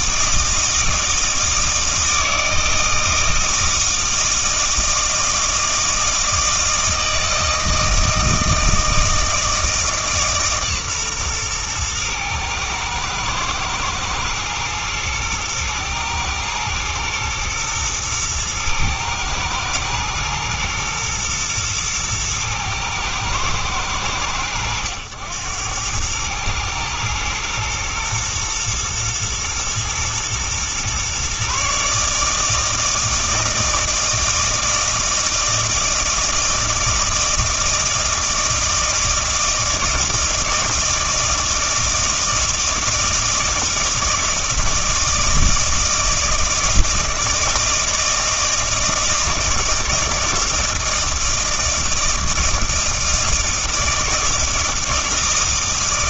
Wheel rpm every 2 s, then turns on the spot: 160, 160, 160, 160, 160, 140, 110, 120, 120, 110, 120, 110, 90, 110, 120, 120, 160, 160, 160, 160, 160, 160, 160, 160, 160, 160, 160, 160.
none